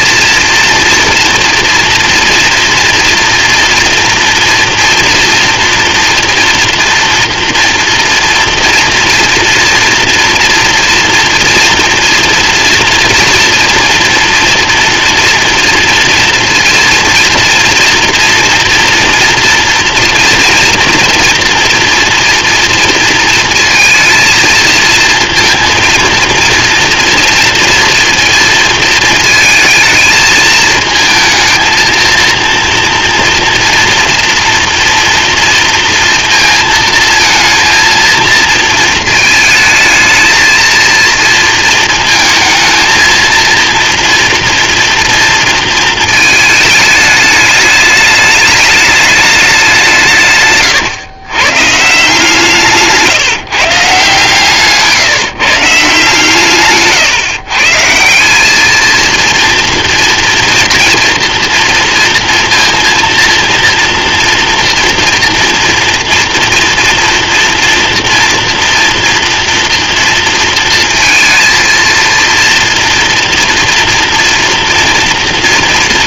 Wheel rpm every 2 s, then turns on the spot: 240, 230, 230, 230, 230, 230, 230, 240, 240, 230, 230, 230, 230, 240, 230, 220, 230, 230, 220, 220, 230, 230, 230, 210, 210, 140, 150, 150, 140, 230, 230, 230, 230, 230, 240, 230, 230, 230.
none